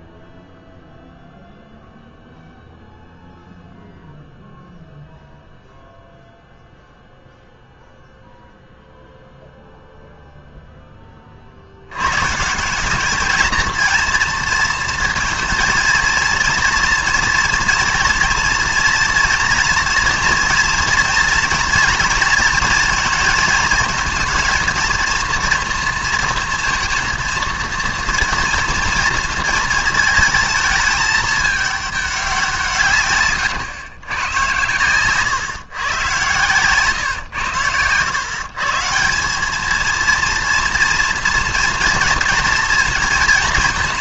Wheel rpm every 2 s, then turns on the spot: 0, 0, 0, 0, 0, 0, 170, 230, 230, 230, 230, 230, 230, 230, 230, 220, 170, 120, 120, 150, 230, 230.
none